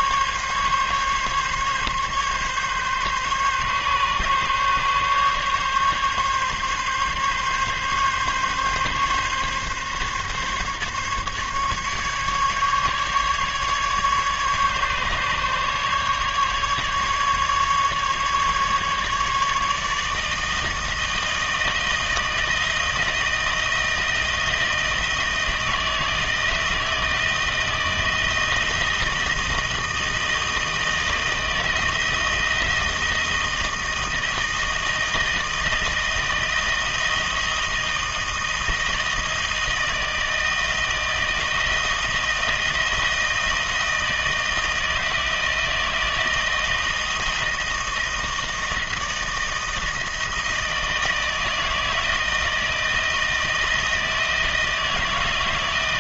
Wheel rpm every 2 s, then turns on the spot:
140, 140, 140, 140, 140, 140, 140, 140, 150, 150, 160, 160, 160, 160, 160, 160, 170, 160, 160, 160, 160, 160, 160, 160, 160, 160, 160, 160.
none